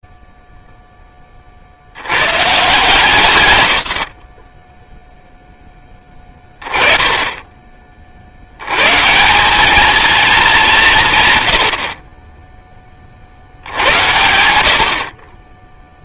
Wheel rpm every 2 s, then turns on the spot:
0, 120, 40, 20, 90, 210, 30, 70.
none